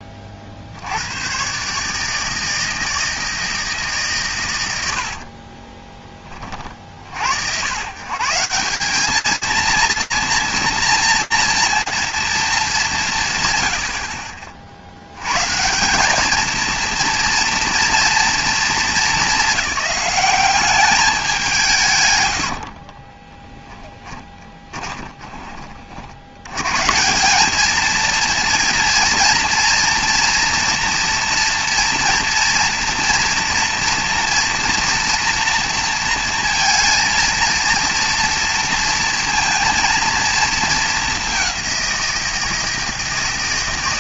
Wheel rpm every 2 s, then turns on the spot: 60, 160, 100, 40, 190, 230, 200, 90, 230, 210, 200, 30, 20, 160, 230, 230, 230, 230, 230, 230, 210, 160.
22-26